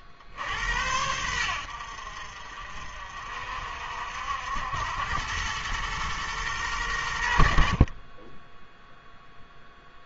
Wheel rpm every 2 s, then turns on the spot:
80, 60, 90, 110, 0.
none